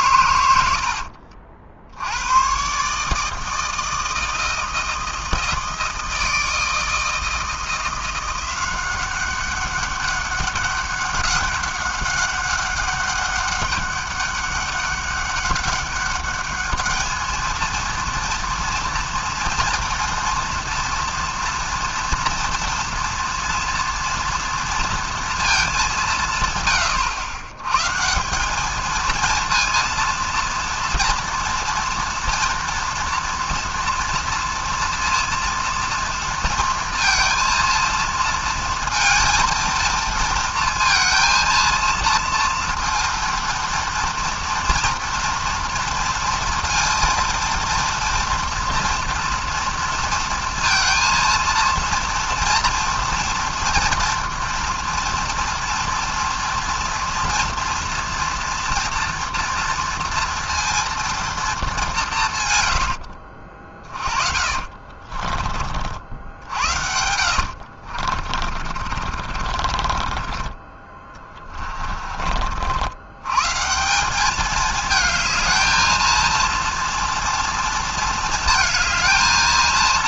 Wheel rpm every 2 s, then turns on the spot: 80, 120, 160, 160, 180, 200, 200, 200, 210, 230, 230, 230, 230, 120, 220, 230, 230, 240, 230, 230, 230, 230, 230, 230, 230, 230, 230, 230, 240, 230, 230, 100, 50, 70, 30, 20, 80, 220, 230, 220.
62-70